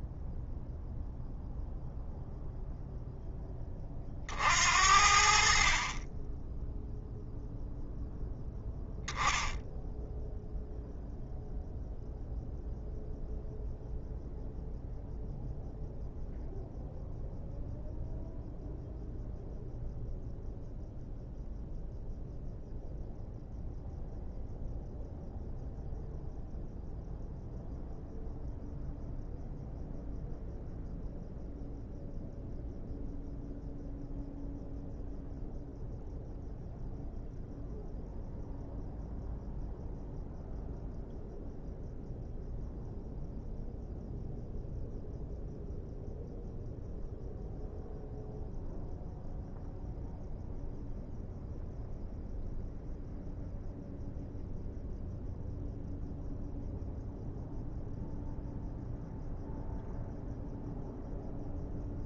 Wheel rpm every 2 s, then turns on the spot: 0, 0, 70, 0, 0, 0, 0, 0, 0, 0, 0, 0, 0, 0, 0, 0, 0, 0, 0, 0, 0, 0, 0, 0, 0, 0, 0, 0, 0, 0, 0.
none